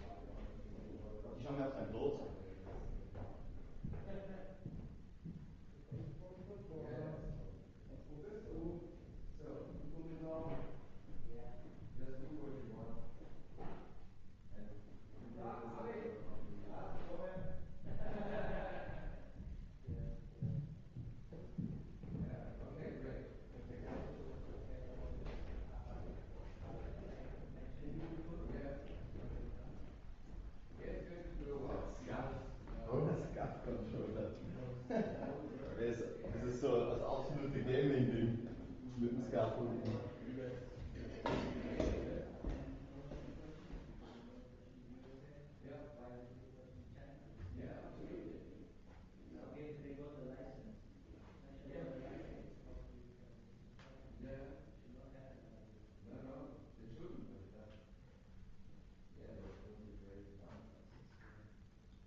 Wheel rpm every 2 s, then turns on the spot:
0, 0, 0, 0, 0, 0, 0, 0, 0, 0, 0, 0, 0, 0, 0, 0, 0, 0, 0, 0, 0, 0, 0, 0, 0, 0, 0, 0, 0, 0, 0.
none